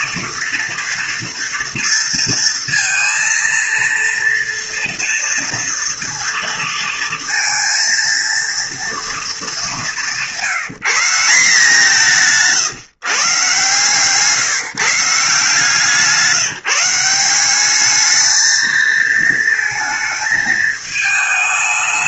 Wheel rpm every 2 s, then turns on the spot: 230, 230, 230, 230, 230, 180, 150, 150, 170, 220, 220.
none